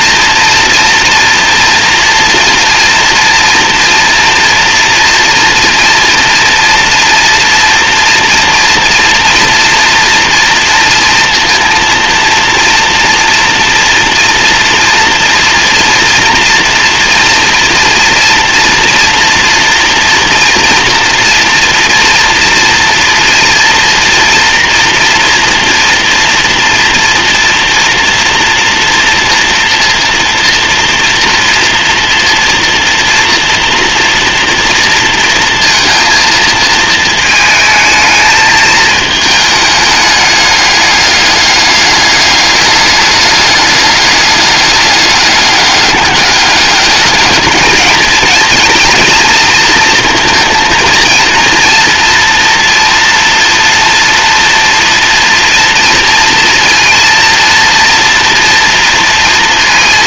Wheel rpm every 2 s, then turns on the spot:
240, 240, 230, 230, 240, 230, 230, 230, 240, 240, 230, 230, 230, 230, 230, 230, 230, 230, 220, 220, 210, 210, 200, 210, 230, 230, 230, 230, 230, 230.
none